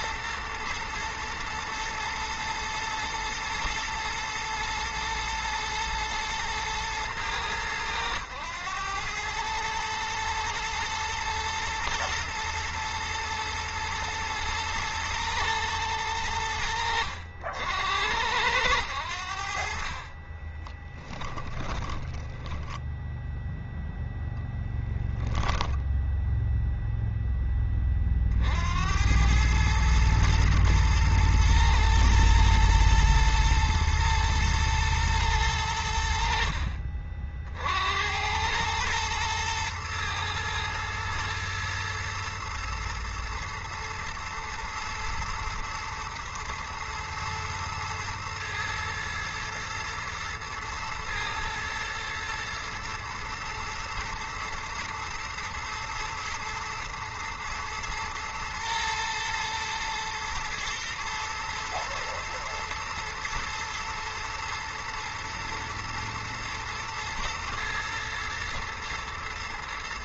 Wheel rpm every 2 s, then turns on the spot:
110, 110, 110, 110, 110, 120, 110, 110, 80, 80, 10, 10, 10, 0, 80, 110, 110, 110, 60, 110, 110, 120, 110, 120, 120, 110, 110, 110, 120, 120, 110, 110, 120, 120, 120.
20-22 24-26